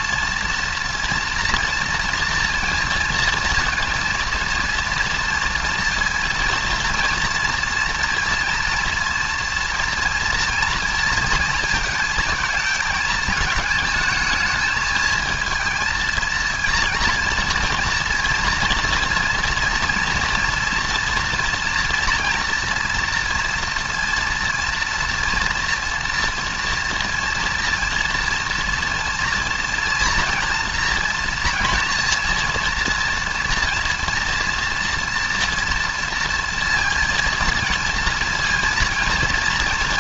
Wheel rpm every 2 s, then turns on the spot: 240, 230, 230, 230, 230, 230, 220, 220, 230, 230, 230, 230, 230, 230, 230, 230, 230, 230, 230, 230.
none